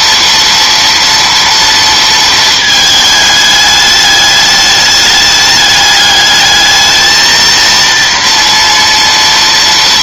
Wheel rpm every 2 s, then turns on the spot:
230, 220, 210, 210, 230.
none